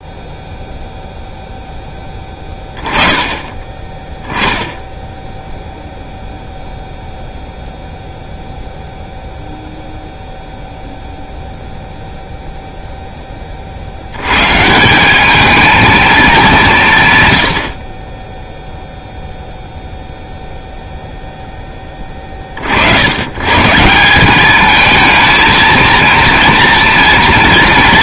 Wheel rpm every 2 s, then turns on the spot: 0, 20, 10, 0, 0, 0, 0, 160, 160, 0, 0, 70, 220, 230.
none